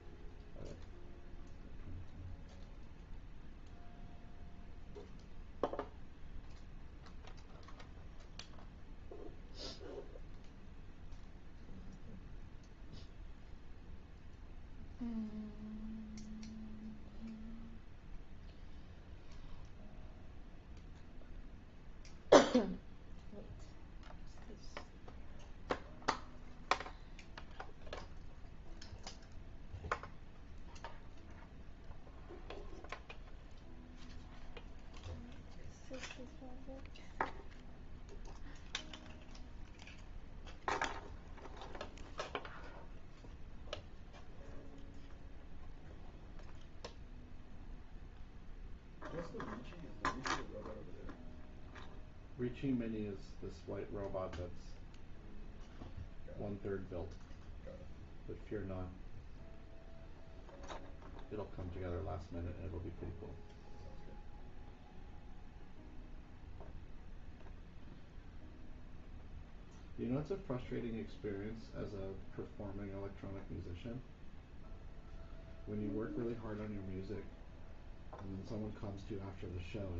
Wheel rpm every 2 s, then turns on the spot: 0, 0, 0, 0, 0, 0, 0, 0, 0, 0, 0, 0, 0, 0, 0, 0, 0, 0, 0, 0, 0, 0, 0, 0, 0, 0, 0, 0, 0, 0, 0, 0, 0, 0, 0, 0, 0, 0, 0, 0.
none